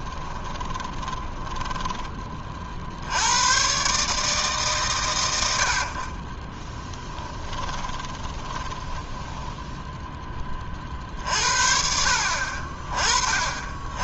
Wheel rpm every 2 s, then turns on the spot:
20, 60, 140, 10, 20, 40, 40.
0-2 6-10